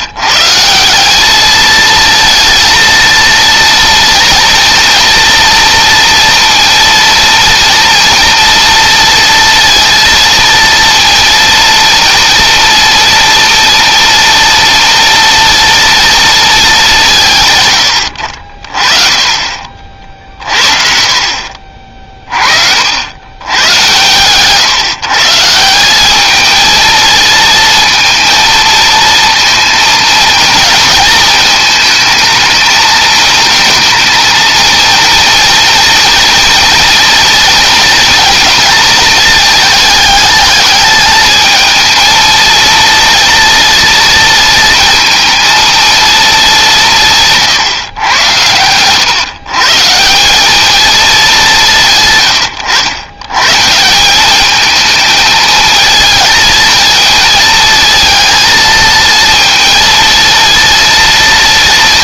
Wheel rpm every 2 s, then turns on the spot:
190, 230, 230, 230, 230, 230, 230, 230, 180, 30, 50, 80, 150, 220, 230, 220, 220, 240, 230, 220, 210, 230, 230, 170, 120, 210, 110, 220, 220, 230, 230.
20-22